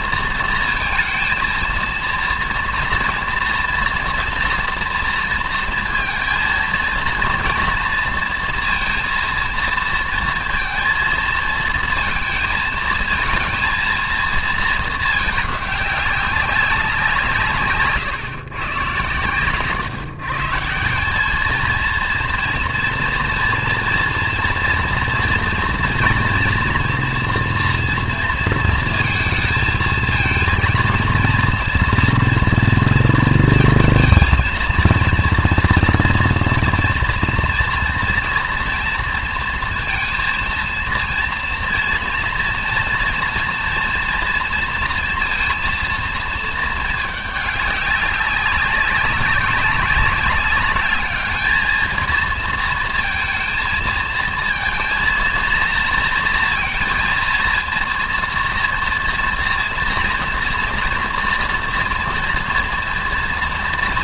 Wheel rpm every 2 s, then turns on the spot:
230, 230, 230, 230, 230, 230, 220, 220, 190, 120, 160, 230, 230, 240, 220, 230, 240, 230, 230, 230, 230, 230, 230, 220, 200, 210, 230, 230, 230, 230, 240, 230.
none